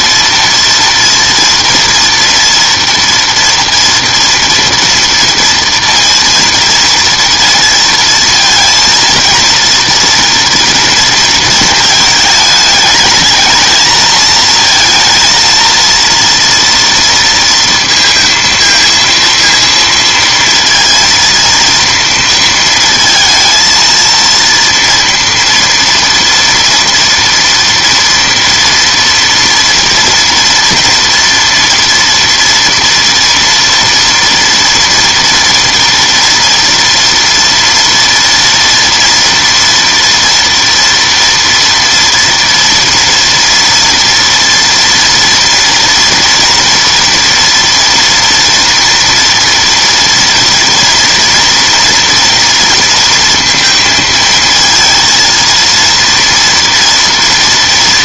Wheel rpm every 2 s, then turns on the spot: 230, 240, 230, 230, 230, 230, 220, 220, 230, 230, 230, 230, 230, 230, 230, 230, 240, 240, 240, 230, 230, 230, 230, 240, 240, 230, 230, 230, 230.
none